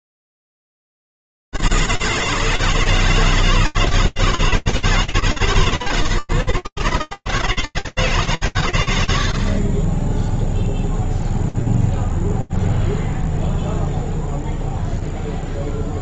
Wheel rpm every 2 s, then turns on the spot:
60, 150, 160, 160, 150, 80, 0, 0.
none